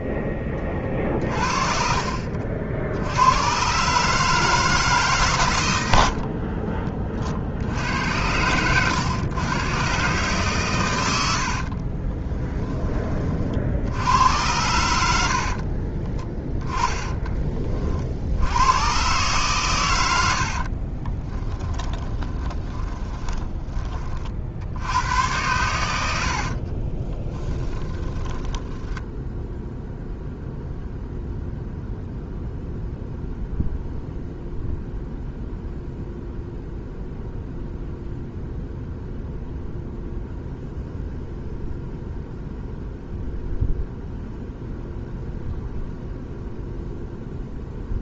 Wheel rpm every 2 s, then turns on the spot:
20, 70, 150, 30, 100, 120, 20, 90, 10, 110, 50, 20, 80, 30, 10, 0, 0, 0, 0, 0, 0, 0, 0, 0.
0-2 14-18 20-24 26-30